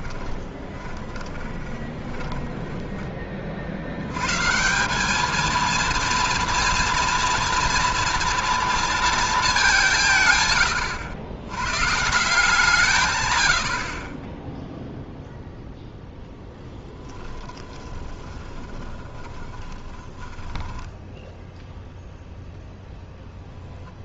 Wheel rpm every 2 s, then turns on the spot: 20, 10, 150, 230, 230, 120, 160, 10, 0, 20, 10, 0.
0-4 14-16 18-22